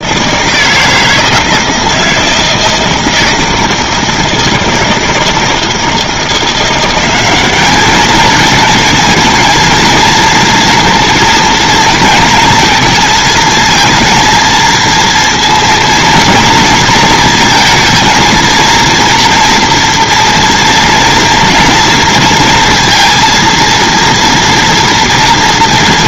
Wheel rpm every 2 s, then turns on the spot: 160, 160, 160, 180, 220, 230, 220, 230, 230, 240, 230, 230, 230.
none